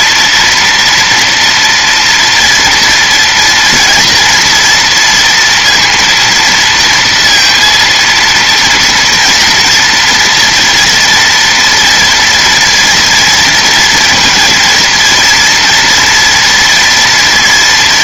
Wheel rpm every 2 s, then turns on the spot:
240, 230, 230, 230, 230, 230, 230, 230, 240.
none